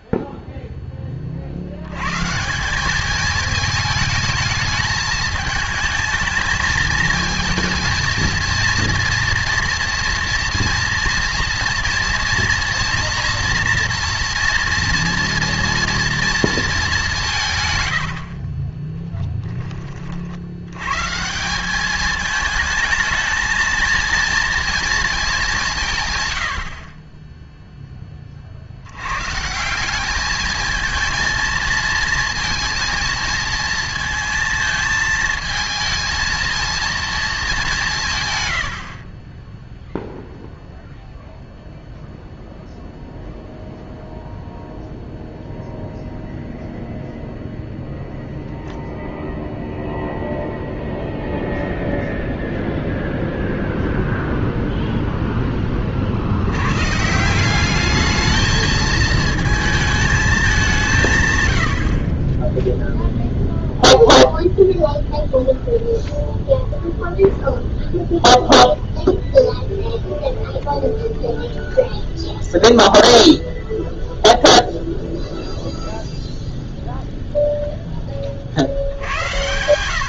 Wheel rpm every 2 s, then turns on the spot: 10, 190, 220, 220, 230, 230, 230, 230, 210, 20, 110, 220, 230, 50, 90, 220, 230, 220, 230, 80, 0, 0, 0, 0, 0, 0, 0, 0, 120, 220, 190, 0, 0, 0, 0, 0, 0, 0, 0, 70.
18-20